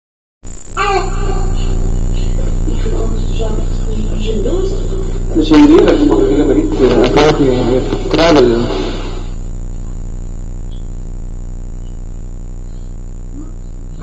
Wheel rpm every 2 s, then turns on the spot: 0, 0, 0, 0, 0, 0, 0.
none